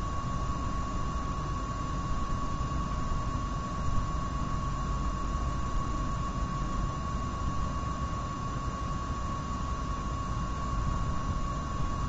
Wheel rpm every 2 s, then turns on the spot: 0, 0, 0, 0, 0, 0.
none